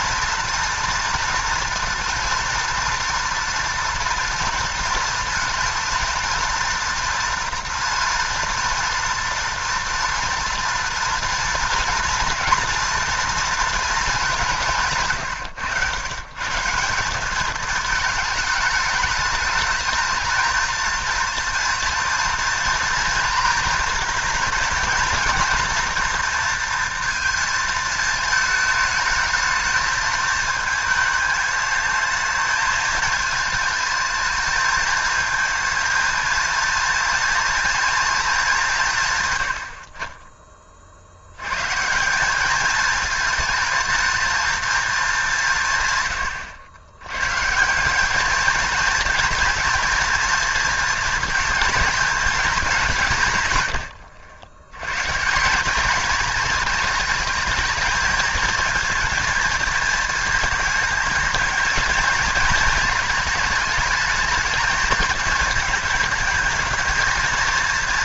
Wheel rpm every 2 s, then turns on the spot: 230, 230, 230, 230, 230, 230, 240, 170, 170, 210, 230, 230, 230, 230, 220, 220, 220, 220, 230, 190, 40, 210, 230, 110, 230, 230, 200, 100, 220, 230, 220, 220, 220, 220.
none